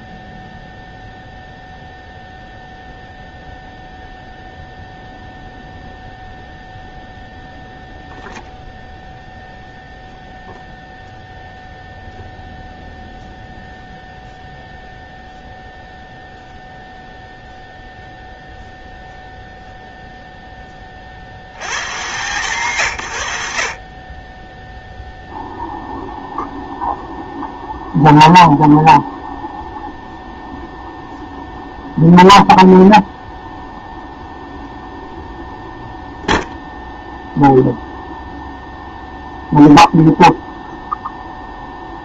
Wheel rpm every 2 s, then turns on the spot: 0, 0, 0, 0, 0, 0, 0, 0, 0, 0, 20, 120, 0, 0, 0, 0, 0, 0, 0, 0, 0.
none